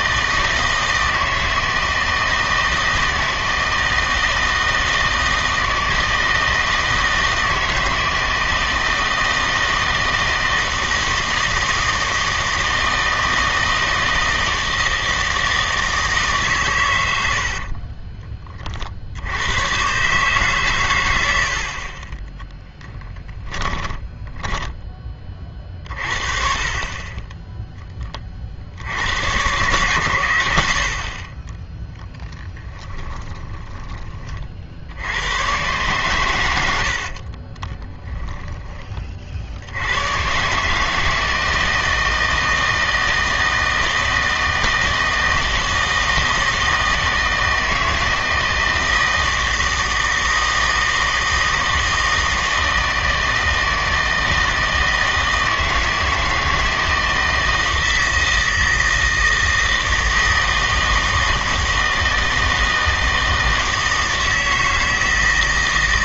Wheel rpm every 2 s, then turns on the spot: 160, 160, 160, 160, 160, 170, 160, 160, 120, 40, 120, 0, 10, 30, 70, 60, 10, 70, 80, 30, 150, 160, 160, 160, 160, 160, 160, 160, 160, 160, 160, 160, 160.
24-26 32-34 36-38